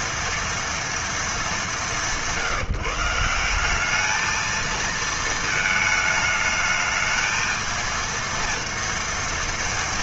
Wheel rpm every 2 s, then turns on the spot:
230, 150, 220, 210, 230.
none